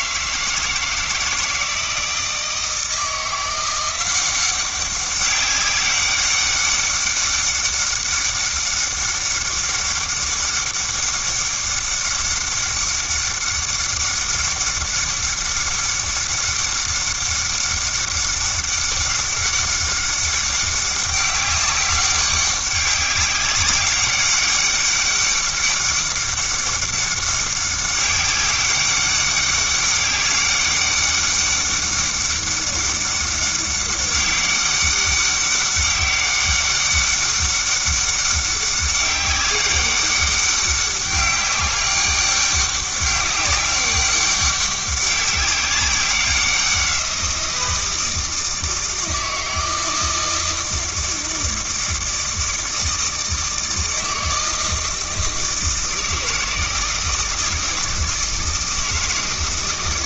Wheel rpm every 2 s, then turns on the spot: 160, 170, 190, 200, 200, 200, 200, 200, 200, 200, 200, 200, 200, 200, 200, 200, 200, 200, 200, 200, 200, 200, 200, 180, 160, 160, 160, 160, 160, 160.
none